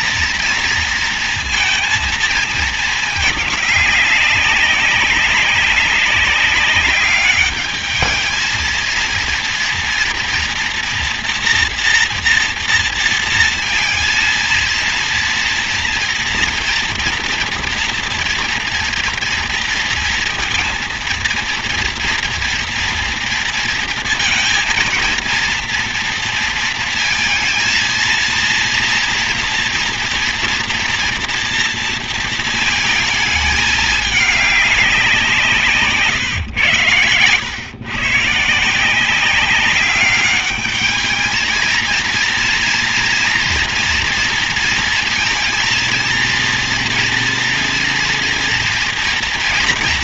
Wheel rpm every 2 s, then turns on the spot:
230, 220, 190, 200, 220, 240, 230, 230, 230, 240, 230, 230, 230, 230, 240, 240, 230, 200, 120, 170, 210, 230, 230, 230, 230.
none